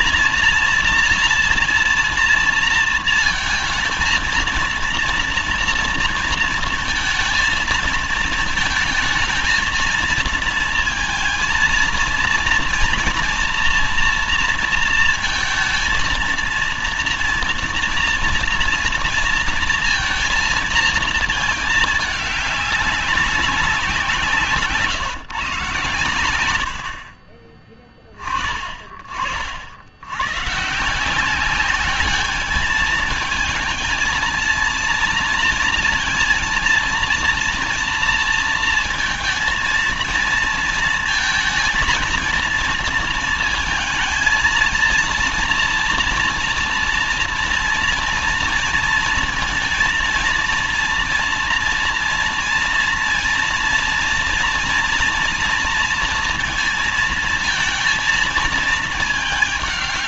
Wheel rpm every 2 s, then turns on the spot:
240, 220, 230, 220, 220, 230, 230, 230, 230, 230, 230, 200, 150, 60, 40, 170, 220, 230, 230, 230, 230, 230, 230, 240, 230, 230, 230, 230, 230, 210.
none